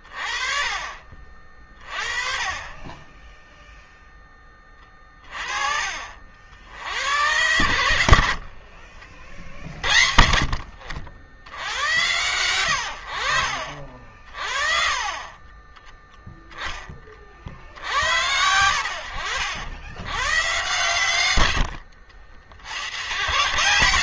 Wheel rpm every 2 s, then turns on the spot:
40, 20, 20, 80, 50, 70, 90, 40, 20, 70, 110, 110.
8-10